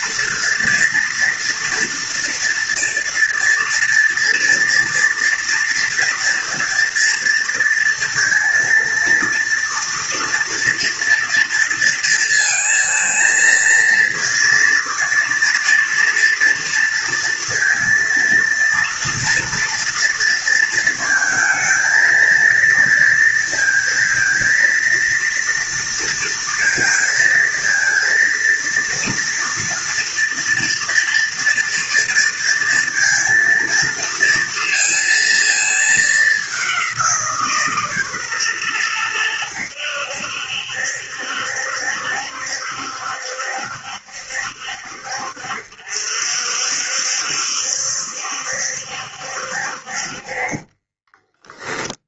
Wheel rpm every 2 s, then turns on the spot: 230, 230, 240, 230, 230, 230, 230, 230, 230, 230, 230, 230, 230, 230, 230, 230, 230, 230, 190, 120, 70, 70, 70, 60, 70, 30.
50-52